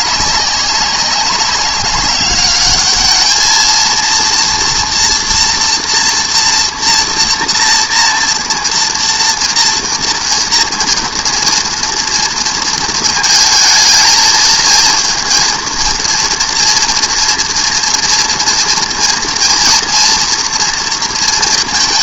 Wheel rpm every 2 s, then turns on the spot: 190, 210, 240, 230, 230, 230, 230, 230, 230, 230, 230.
none